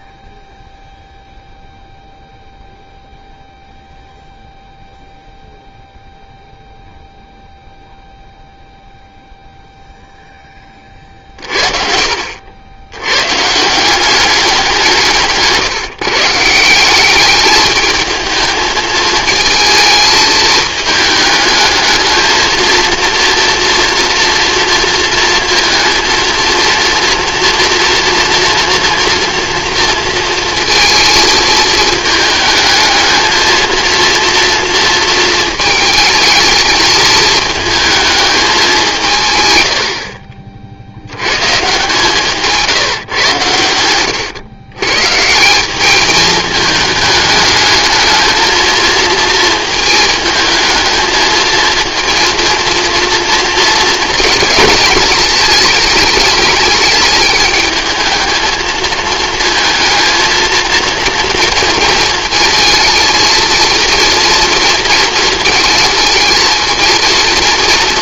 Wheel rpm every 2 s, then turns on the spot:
0, 0, 0, 0, 0, 20, 80, 180, 180, 220, 220, 230, 230, 230, 230, 230, 220, 230, 220, 190, 50, 150, 120, 210, 220, 220, 230, 220, 210, 220, 230, 230, 230, 230.
42-44